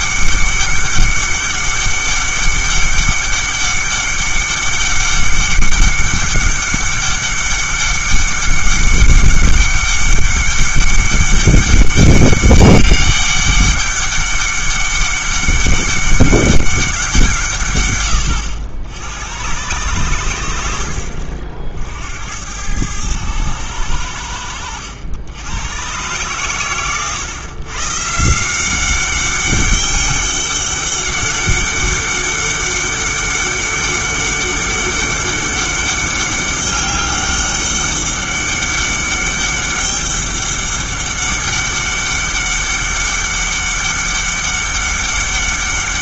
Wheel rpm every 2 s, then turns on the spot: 200, 200, 200, 200, 200, 200, 200, 200, 190, 80, 90, 100, 90, 120, 190, 200, 200, 200, 200, 200, 200, 200, 200.
none